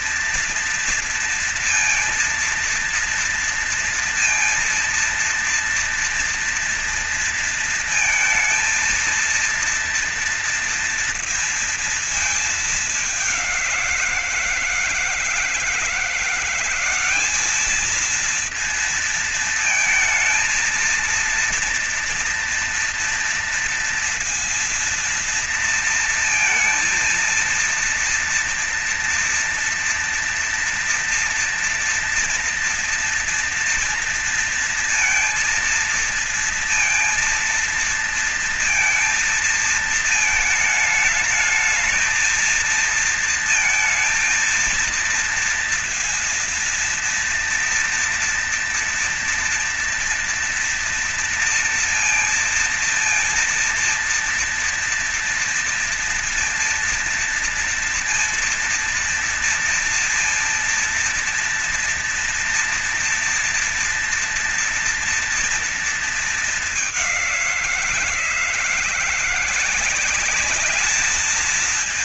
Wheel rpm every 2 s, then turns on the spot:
230, 230, 230, 230, 230, 230, 220, 170, 180, 220, 220, 230, 230, 230, 230, 230, 230, 230, 230, 230, 220, 220, 220, 230, 230, 230, 230, 230, 230, 230, 230, 230, 230, 220, 170, 200.
none